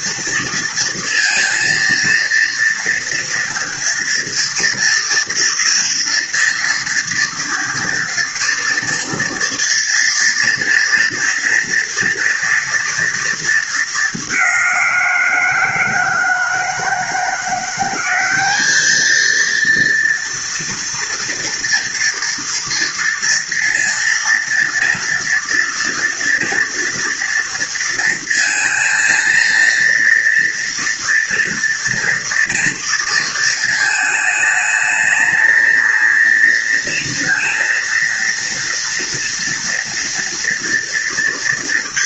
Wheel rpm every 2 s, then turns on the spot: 230, 230, 240, 230, 230, 230, 220, 170, 170, 220, 230, 230, 230, 230, 230, 230, 220, 220, 230, 230, 230.
none